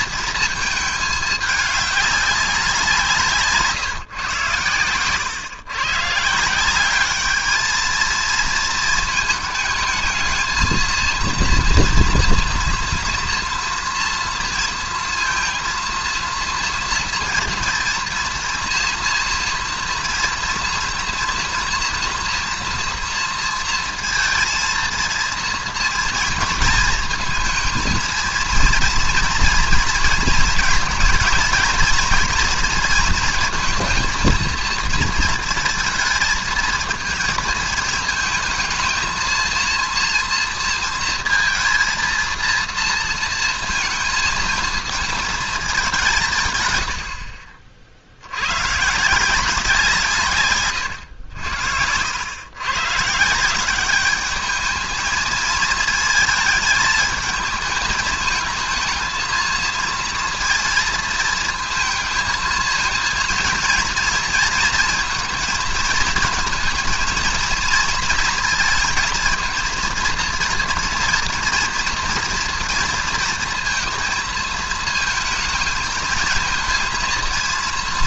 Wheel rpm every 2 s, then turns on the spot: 220, 170, 120, 190, 220, 220, 230, 230, 230, 230, 230, 230, 230, 230, 230, 220, 230, 220, 230, 220, 230, 230, 220, 100, 130, 110, 130, 220, 220, 220, 230, 220, 230, 220, 230, 240, 230, 230, 230.
50-52